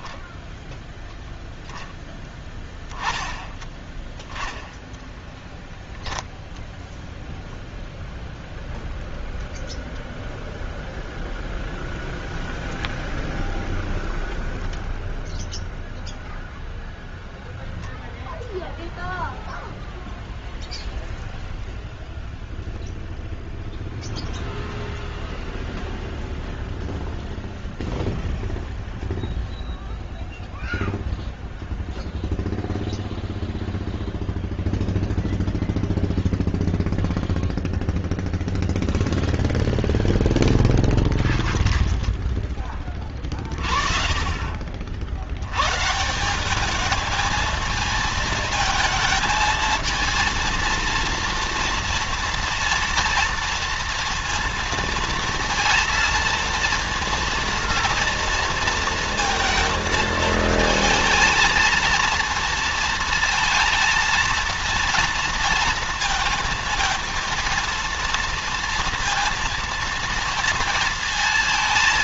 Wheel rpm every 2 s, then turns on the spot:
0, 10, 20, 0, 0, 0, 0, 0, 0, 0, 0, 0, 0, 0, 0, 0, 0, 0, 0, 0, 10, 30, 50, 210, 220, 230, 230, 230, 230, 230, 220, 230, 230, 220, 230, 230.
4-6 40-44